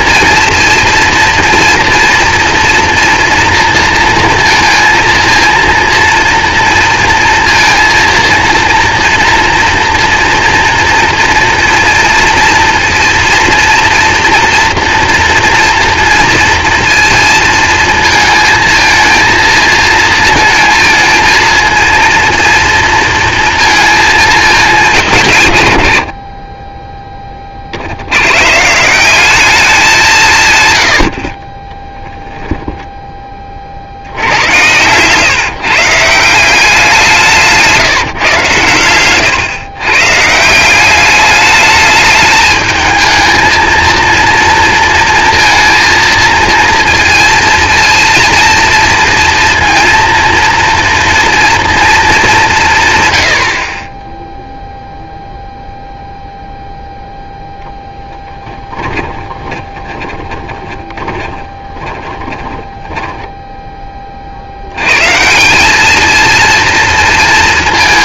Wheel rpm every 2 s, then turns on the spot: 230, 230, 230, 230, 230, 230, 230, 230, 230, 220, 230, 230, 200, 20, 160, 100, 10, 120, 180, 120, 180, 220, 230, 230, 230, 230, 140, 0, 0, 20, 20, 10, 100, 230.
32-34 38-40 58-64